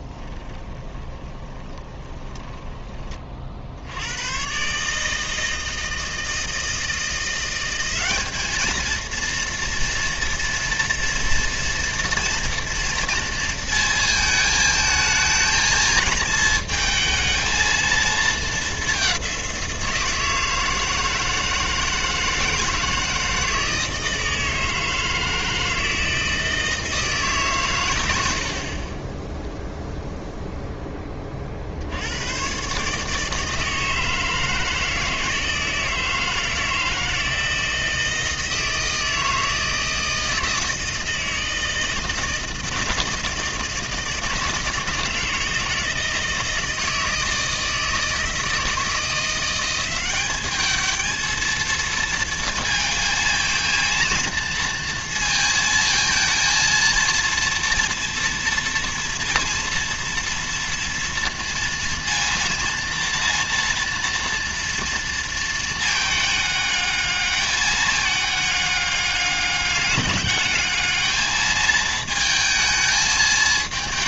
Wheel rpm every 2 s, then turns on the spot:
20, 20, 140, 160, 220, 230, 230, 220, 220, 210, 160, 160, 160, 160, 40, 10, 130, 160, 160, 160, 160, 160, 160, 160, 160, 210, 230, 230, 230, 230, 230, 230, 230, 210, 210, 210, 220.
0-2